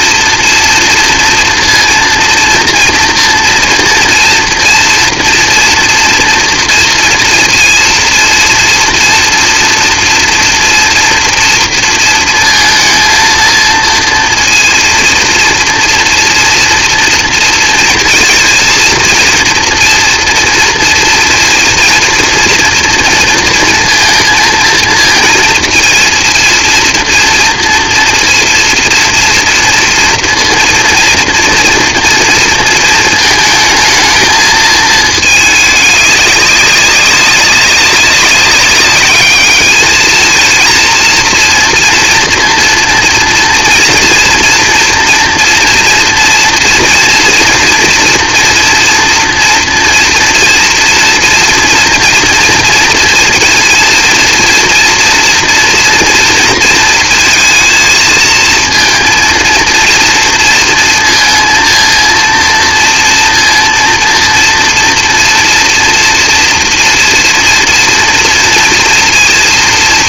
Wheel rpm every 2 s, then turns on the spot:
230, 230, 230, 230, 230, 230, 230, 230, 240, 230, 230, 230, 230, 230, 230, 230, 230, 220, 200, 200, 230, 230, 230, 230, 230, 230, 230, 230, 230, 230, 230, 230, 230, 230, 230.
none